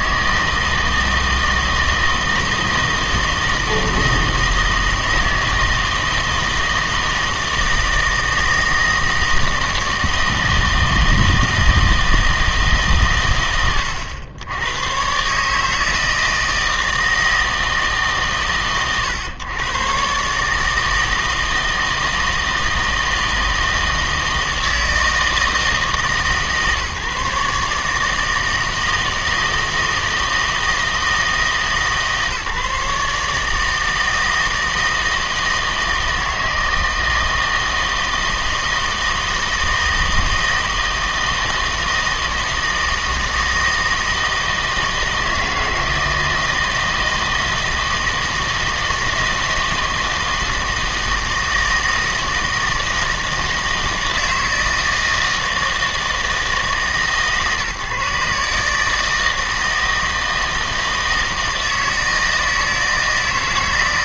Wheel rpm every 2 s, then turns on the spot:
160, 160, 160, 160, 160, 160, 150, 120, 160, 130, 150, 160, 160, 150, 160, 160, 150, 160, 160, 160, 160, 160, 160, 160, 160, 160, 160, 160, 150, 150, 160, 160.
none